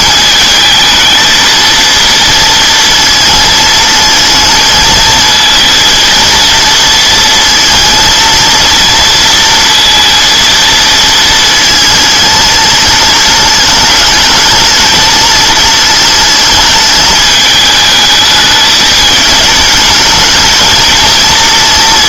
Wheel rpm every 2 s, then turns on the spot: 220, 230, 220, 230, 230, 230, 220, 210, 220, 220, 220.
none